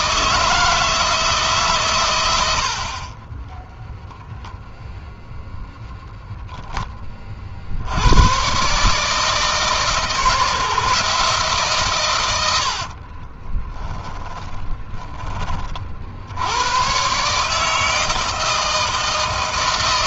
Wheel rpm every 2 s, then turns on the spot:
160, 50, 0, 10, 140, 160, 60, 30, 110, 160.
12-16